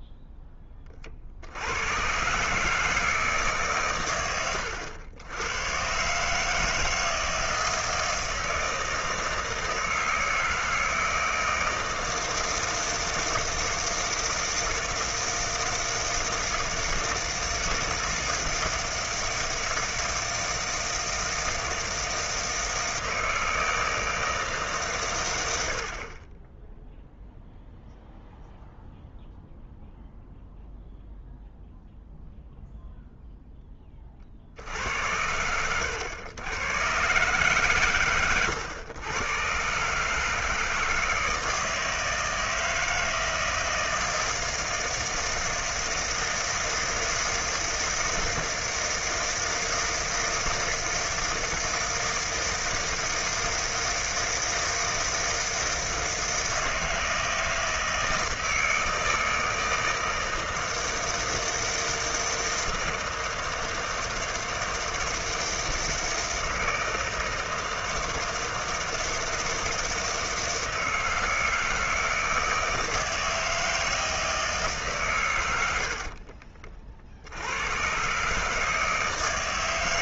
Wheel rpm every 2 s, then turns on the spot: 20, 150, 90, 160, 160, 160, 160, 160, 160, 160, 160, 160, 150, 10, 0, 0, 0, 70, 110, 110, 160, 160, 160, 160, 160, 160, 160, 160, 160, 160, 160, 160, 160, 160, 160, 160, 160, 160, 50, 150.
none